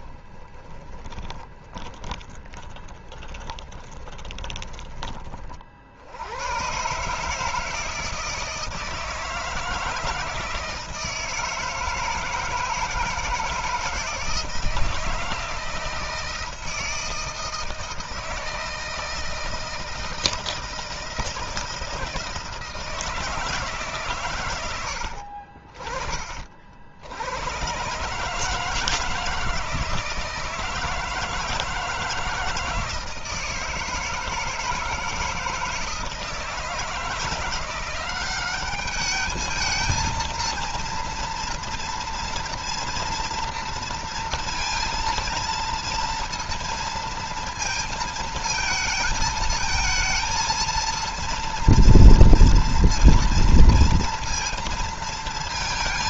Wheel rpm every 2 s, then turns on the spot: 20, 10, 20, 130, 160, 160, 160, 160, 160, 160, 160, 160, 90, 80, 160, 160, 160, 160, 160, 200, 230, 230, 230, 230, 220, 230, 230, 230.
0-4 24-26